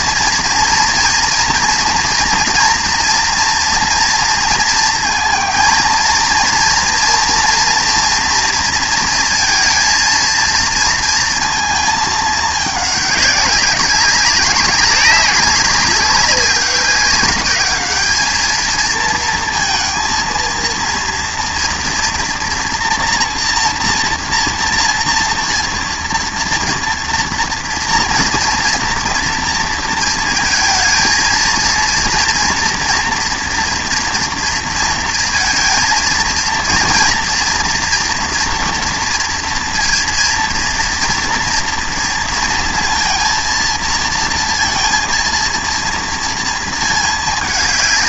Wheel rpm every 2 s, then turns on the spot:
230, 230, 230, 230, 230, 230, 210, 190, 190, 220, 230, 230, 230, 230, 230, 230, 230, 230, 230, 230, 230, 230, 230, 220.
none